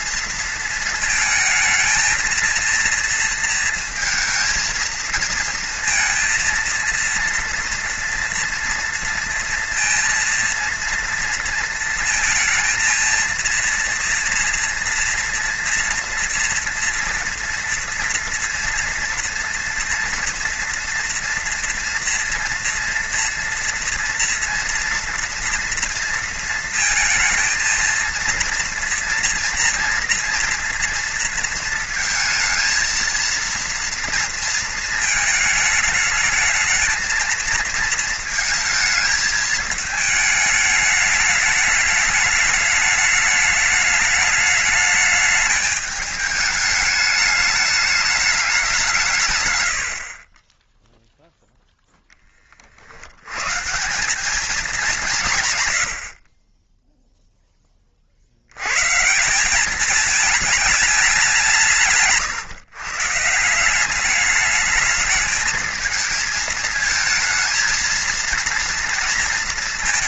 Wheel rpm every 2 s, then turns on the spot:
230, 230, 230, 230, 230, 230, 230, 230, 230, 230, 230, 230, 230, 230, 240, 240, 220, 220, 220, 220, 210, 210, 210, 210, 190, 20, 40, 200, 20, 110, 210, 130, 210, 220, 230.
none